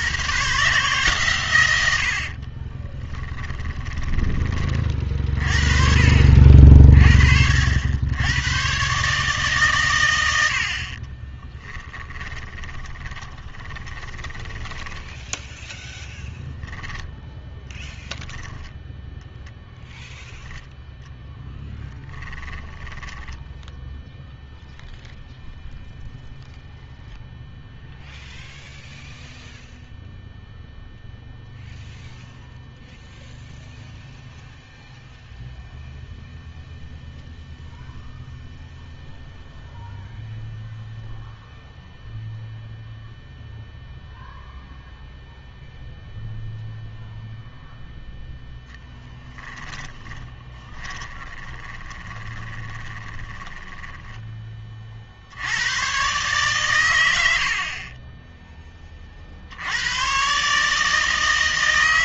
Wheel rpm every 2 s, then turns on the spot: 140, 20, 30, 50, 120, 50, 20, 10, 10, 0, 0, 20, 0, 0, 0, 0, 0, 0, 0, 0, 0, 0, 0, 0, 0, 20, 10, 40, 110, 20, 150.
2-4 12-16 22-24 50-54